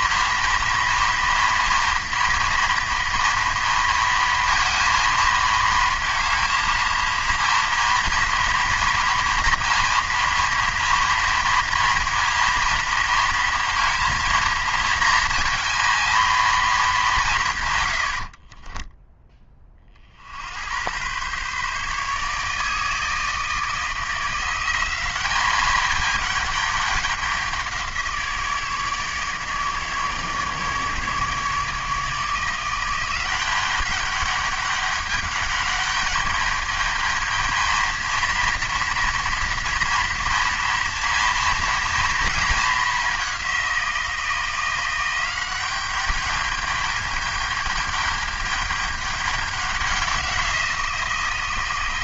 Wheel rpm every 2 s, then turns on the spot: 230, 230, 230, 230, 230, 240, 230, 230, 220, 20, 90, 160, 180, 210, 160, 150, 170, 200, 210, 230, 230, 210, 170, 210, 210, 170.
18-20